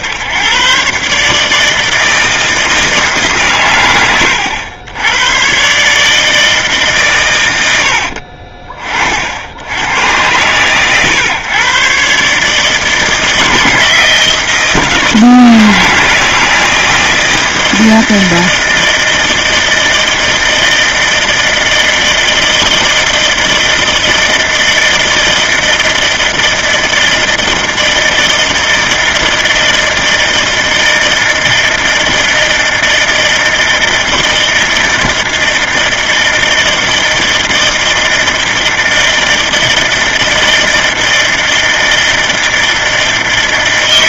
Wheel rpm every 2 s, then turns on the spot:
130, 150, 90, 130, 40, 120, 160, 160, 160, 160, 160, 160, 160, 160, 160, 160, 160, 160, 160, 160, 160, 160.
none